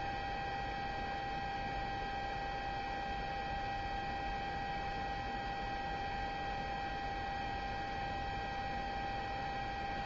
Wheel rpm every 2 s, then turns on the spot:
0, 0, 0, 0, 0.
none